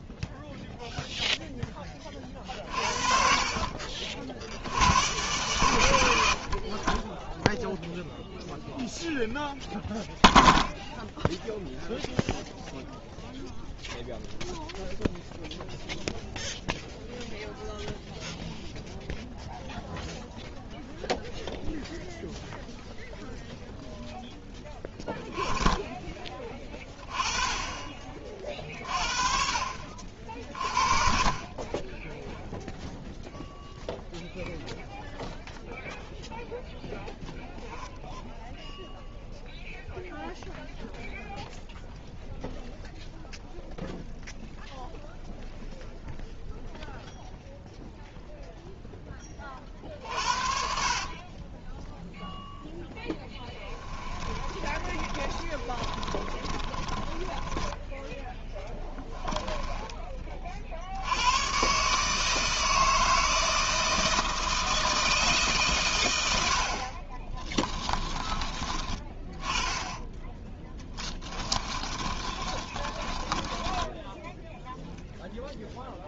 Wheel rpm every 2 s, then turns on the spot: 0, 50, 80, 30, 0, 0, 0, 0, 0, 0, 0, 0, 10, 20, 50, 50, 0, 0, 10, 0, 0, 0, 0, 0, 0, 50, 0, 30, 30, 10, 60, 160, 160, 50, 20, 10, 30, 0.
50-52 54-60 70-74